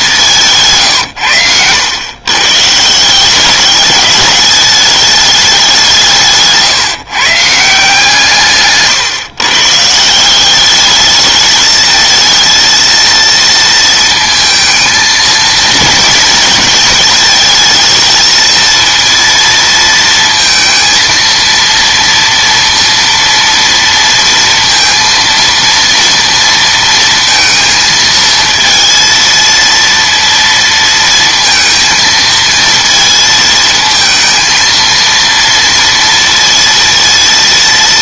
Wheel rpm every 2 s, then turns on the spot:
150, 150, 210, 150, 140, 200, 230, 220, 230, 230, 230, 230, 230, 230, 230, 230, 220, 230, 230.
none